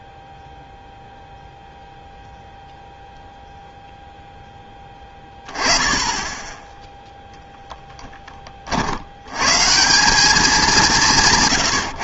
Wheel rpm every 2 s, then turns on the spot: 0, 0, 10, 10, 40, 200.
none